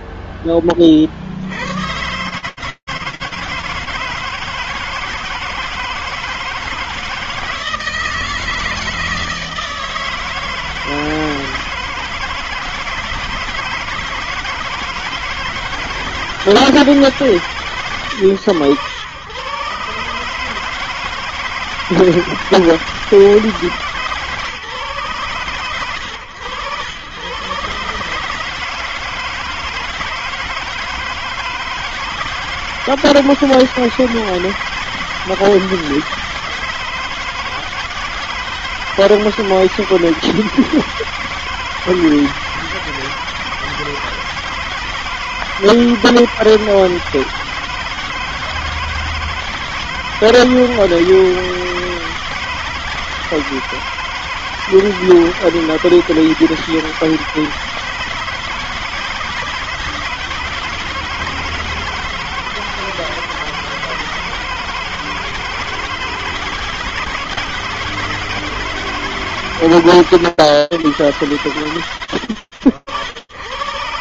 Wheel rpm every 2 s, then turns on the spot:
0, 30, 150, 160, 160, 160, 160, 160, 160, 140, 130, 160, 150, 100, 140, 160, 160, 160, 160, 160, 160, 160, 160, 160, 160, 160, 160, 160, 160, 160, 170, 160, 160, 160, 160, 130, 80.
none